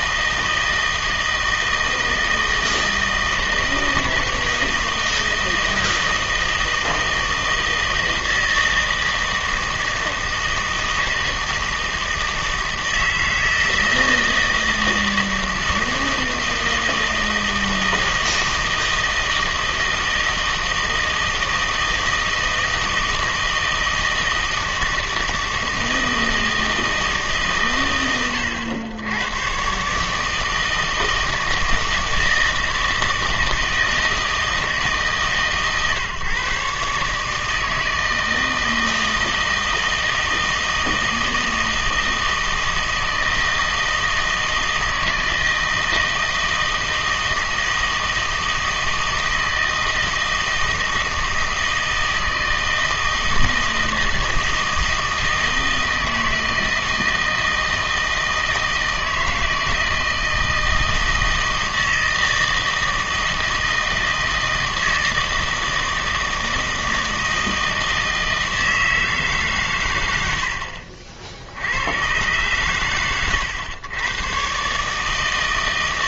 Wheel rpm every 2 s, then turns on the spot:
160, 160, 160, 160, 160, 160, 160, 160, 160, 160, 160, 160, 160, 160, 100, 160, 160, 160, 140, 160, 160, 160, 160, 160, 160, 160, 160, 160, 160, 160, 160, 160, 160, 160, 160, 70, 130, 140.
none